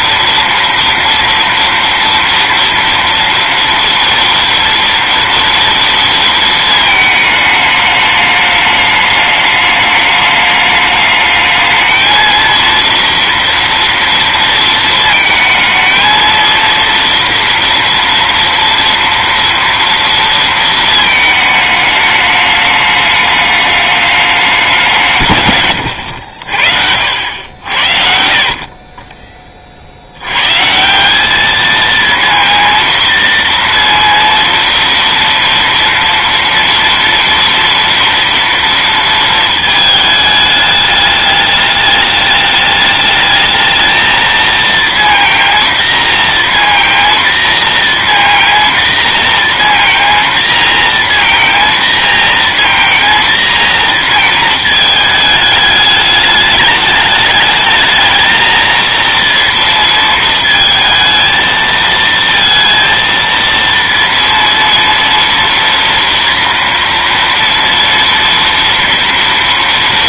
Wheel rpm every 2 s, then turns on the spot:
230, 240, 230, 220, 210, 210, 230, 220, 230, 230, 220, 210, 160, 60, 20, 160, 230, 230, 230, 230, 210, 210, 230, 230, 230, 230, 230, 220, 210, 230, 230, 230, 230, 230, 230.
none